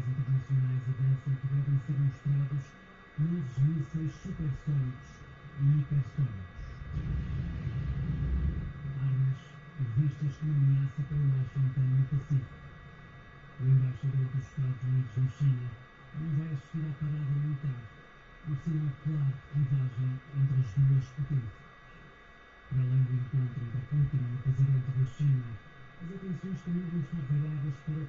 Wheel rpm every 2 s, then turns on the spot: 0, 0, 0, 0, 0, 0, 0, 0, 0, 0, 0, 0, 0, 0.
none